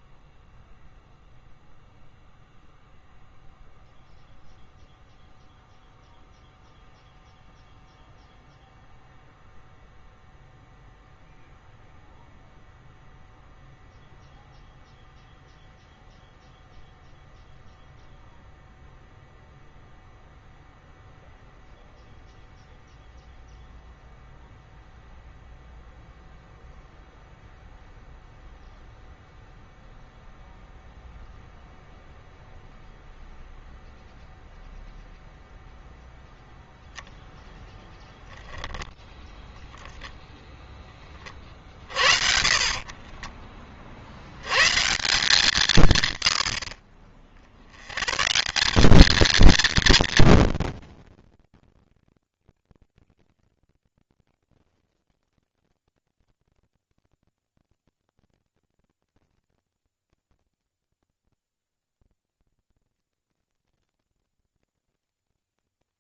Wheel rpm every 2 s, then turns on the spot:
0, 0, 0, 0, 0, 0, 0, 0, 0, 0, 0, 0, 0, 0, 0, 0, 0, 0, 0, 0, 20, 30, 150, 60, 210, 230, 210, 190, 200, 220, 100, 40, 140.
42-44 60-64